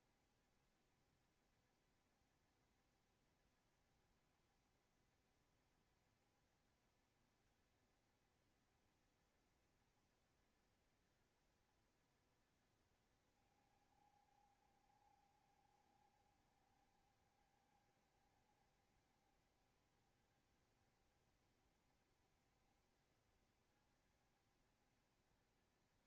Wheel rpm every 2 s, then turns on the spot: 70, 70, 70, 70, 70, 70, 60, 70, 70, 70, 70, 70, 70.
none